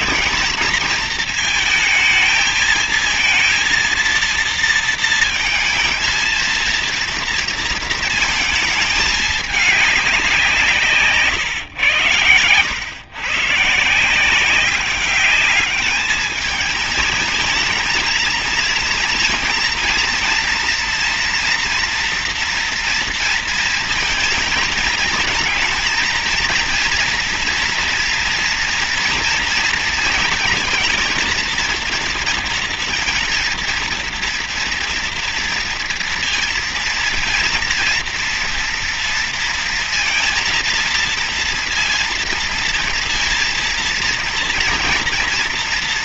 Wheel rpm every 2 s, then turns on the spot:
220, 220, 230, 230, 220, 180, 110, 180, 220, 230, 230, 230, 220, 230, 230, 230, 230, 230, 230, 230, 230, 230, 230.
none